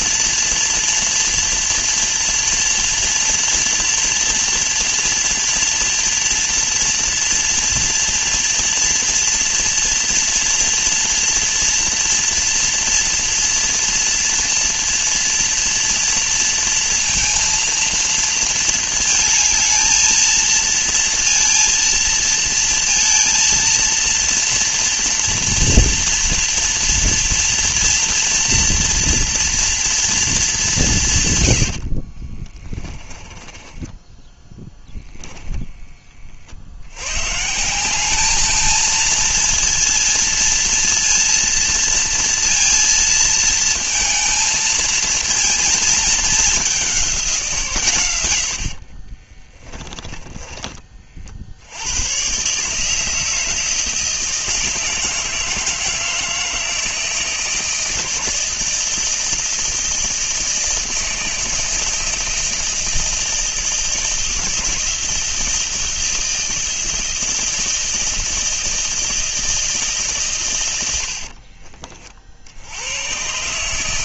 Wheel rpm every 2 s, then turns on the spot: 240, 230, 230, 230, 230, 230, 230, 230, 230, 220, 230, 230, 230, 230, 240, 150, 20, 10, 100, 230, 230, 230, 230, 190, 60, 40, 160, 160, 160, 160, 160, 160, 160, 160, 160, 90, 100.
32-34 48-50 70-72